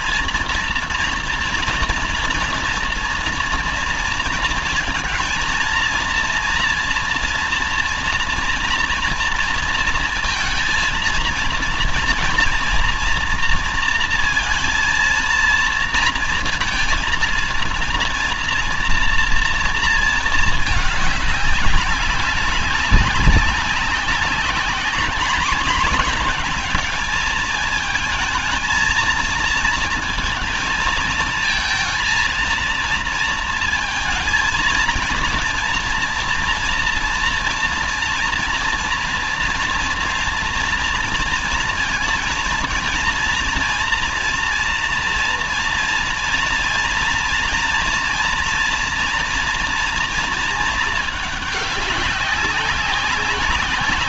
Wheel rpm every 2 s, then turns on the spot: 230, 230, 230, 240, 230, 230, 230, 230, 230, 230, 220, 200, 200, 220, 220, 220, 230, 230, 230, 230, 230, 230, 230, 230, 230, 230, 200.
none